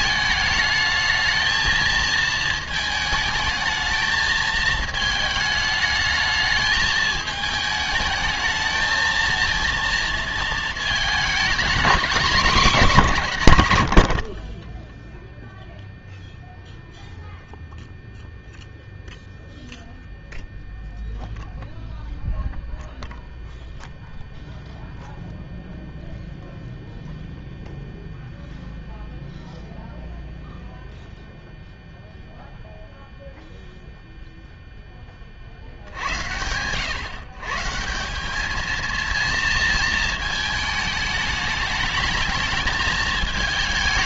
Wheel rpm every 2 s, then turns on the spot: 220, 220, 220, 220, 220, 220, 210, 20, 0, 0, 0, 0, 0, 0, 0, 0, 0, 0, 110, 220, 220, 220.
none